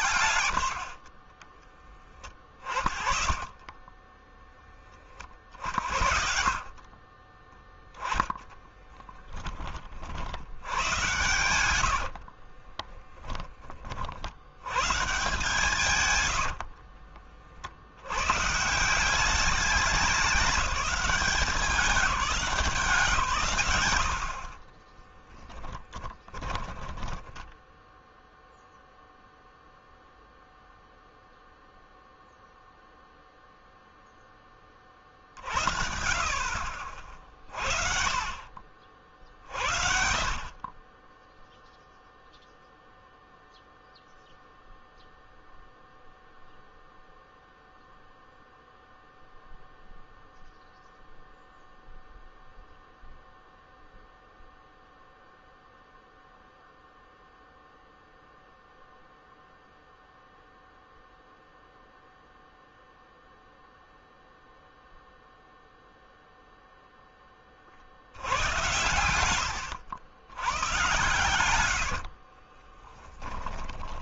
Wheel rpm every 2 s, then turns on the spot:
70, 20, 30, 40, 10, 120, 20, 130, 60, 170, 190, 170, 30, 20, 0, 0, 0, 30, 50, 50, 20, 0, 0, 0, 0, 0, 0, 0, 0, 0, 0, 0, 0, 0, 100, 110, 30.
0-4 8-10 12-14 16-18 24-28 70-74